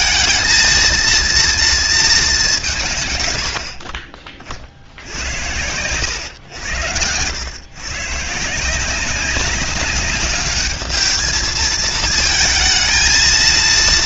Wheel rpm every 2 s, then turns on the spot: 230, 130, 70, 100, 180, 210, 220.
none